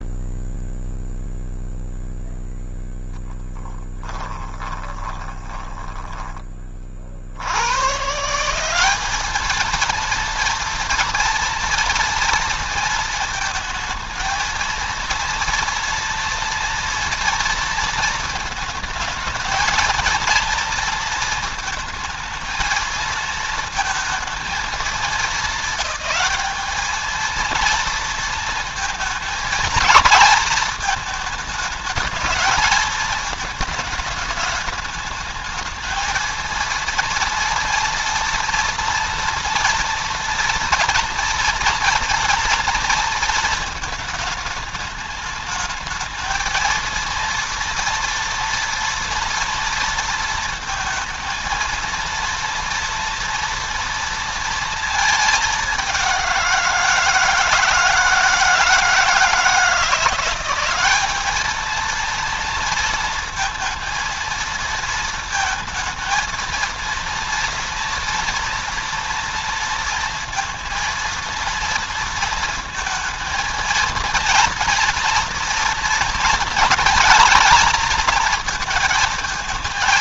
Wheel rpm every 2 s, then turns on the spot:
0, 0, 20, 20, 180, 230, 230, 230, 230, 220, 230, 220, 230, 220, 230, 220, 220, 210, 230, 230, 230, 230, 220, 220, 230, 230, 230, 230, 180, 160, 180, 230, 230, 230, 230, 230, 230, 230, 230, 230.
4-6